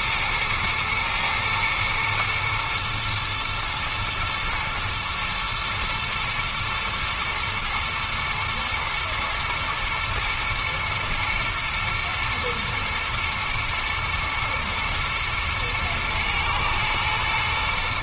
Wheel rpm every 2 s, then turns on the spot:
110, 110, 120, 120, 120, 120, 110, 110, 120.
none